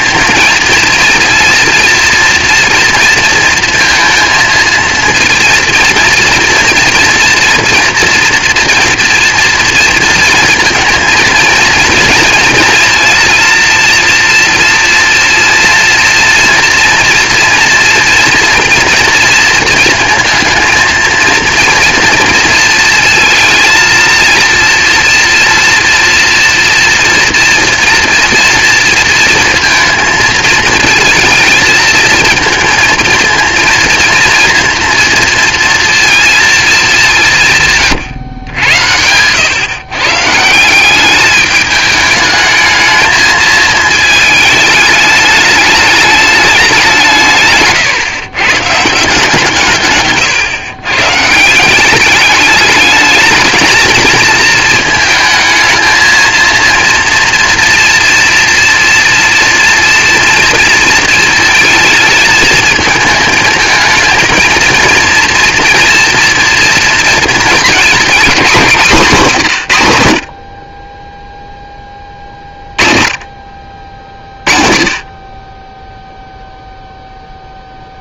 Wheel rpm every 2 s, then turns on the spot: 230, 230, 230, 230, 240, 230, 230, 230, 240, 230, 230, 230, 230, 230, 230, 220, 230, 230, 230, 100, 170, 220, 220, 200, 140, 130, 220, 230, 230, 230, 230, 220, 230, 230, 210, 50, 30, 40, 0.
none